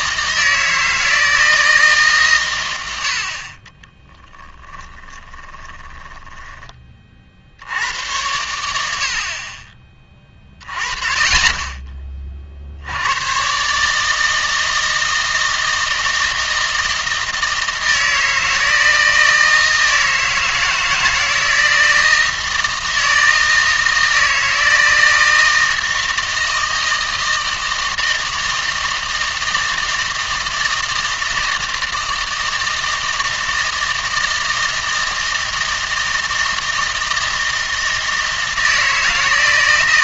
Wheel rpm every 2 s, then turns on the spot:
160, 110, 10, 30, 80, 30, 60, 160, 160, 160, 160, 160, 160, 160, 160, 160, 160, 160, 160, 160.
4-6